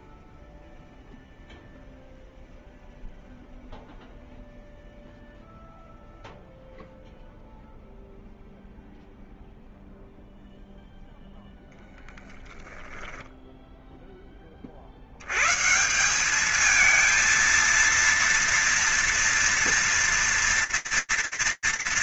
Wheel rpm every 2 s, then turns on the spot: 0, 0, 0, 0, 0, 0, 10, 20, 110, 230, 230.
none